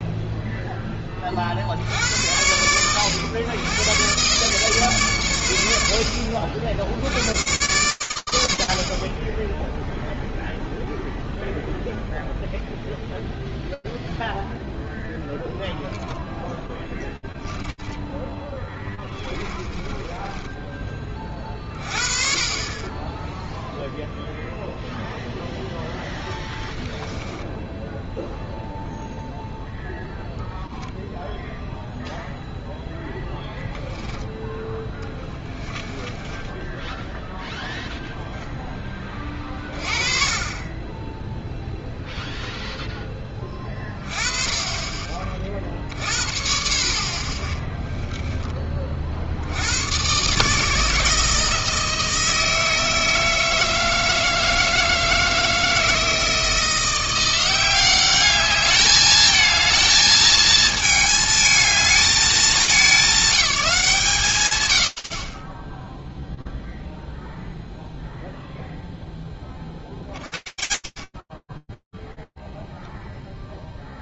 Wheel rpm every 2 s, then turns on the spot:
0, 80, 120, 80, 110, 0, 0, 0, 0, 10, 20, 20, 0, 10, 0, 0, 0, 10, 0, 10, 20, 10, 30, 40, 30, 150, 160, 160, 170, 210, 220, 190, 80, 0, 0, 90, 0.
18-20 26-28